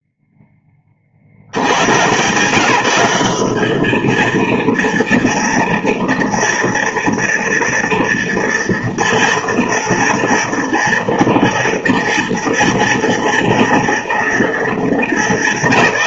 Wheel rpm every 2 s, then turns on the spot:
10, 150, 230, 230, 230, 230, 230, 230.
none